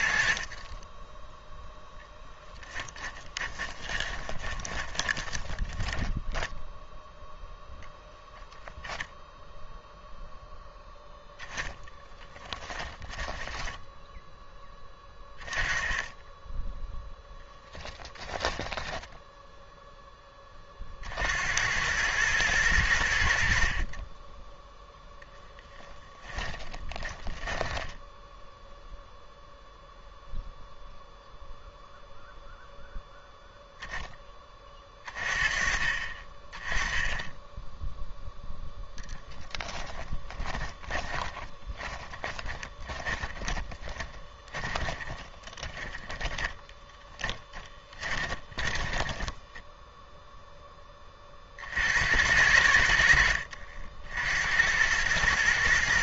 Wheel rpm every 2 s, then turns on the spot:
30, 10, 20, 0, 0, 0, 10, 10, 0, 20, 40, 100, 0, 20, 0, 0, 0, 20, 10, 10, 20, 20, 20, 10, 20, 10, 80, 90.
2-6 12-14 18-20 26-28 38-50